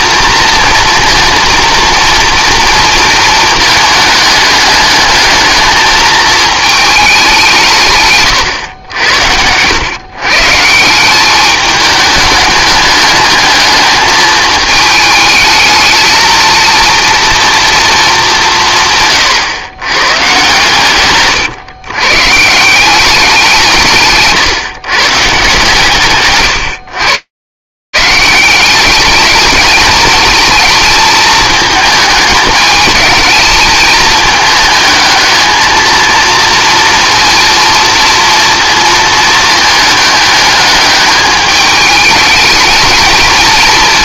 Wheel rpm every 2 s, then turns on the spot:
230, 230, 210, 220, 100, 160, 210, 220, 230, 190, 130, 160, 140, 140, 210, 220, 220, 220, 230, 220, 210, 220.
none